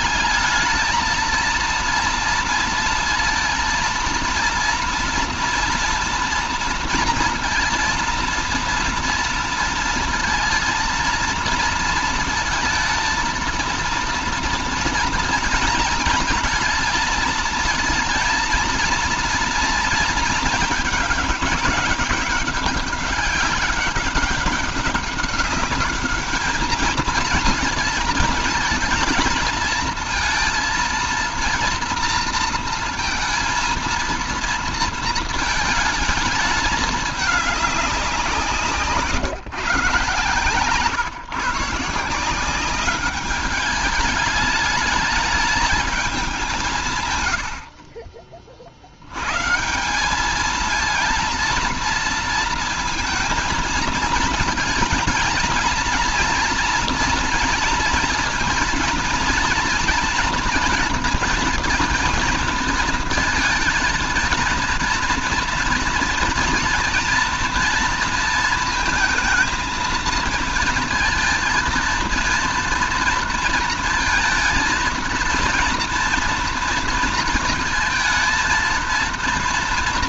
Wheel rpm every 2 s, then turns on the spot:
220, 230, 230, 230, 230, 230, 220, 230, 230, 230, 220, 200, 200, 220, 230, 230, 230, 230, 220, 170, 140, 180, 210, 180, 60, 220, 230, 230, 240, 230, 230, 230, 230, 230, 230, 230, 230, 230, 230, 230.
none